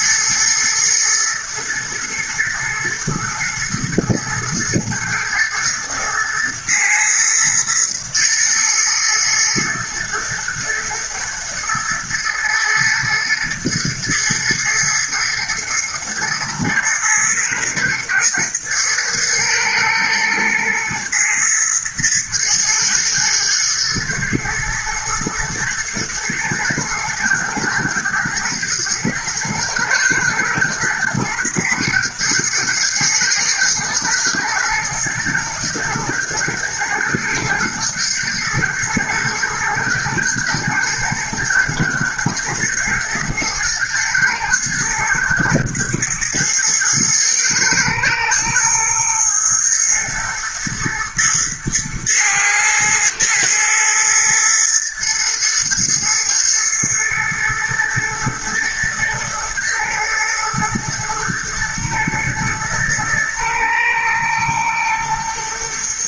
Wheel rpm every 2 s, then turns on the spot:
110, 120, 110, 120, 120, 120, 110, 110, 120, 120, 110, 120, 110, 110, 110, 110, 120, 120, 110, 120, 110, 110, 110, 110, 110, 110, 110, 120, 110, 110, 120, 120, 120.
none